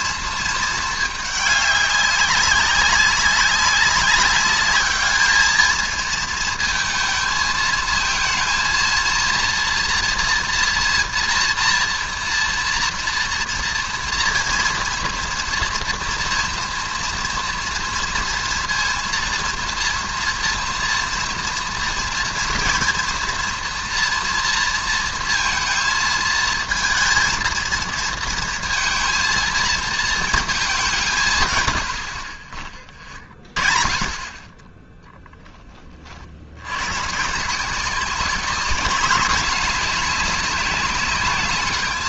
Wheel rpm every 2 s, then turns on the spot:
220, 200, 200, 220, 230, 240, 230, 230, 230, 230, 230, 230, 230, 220, 230, 220, 40, 20, 80, 200, 200.
none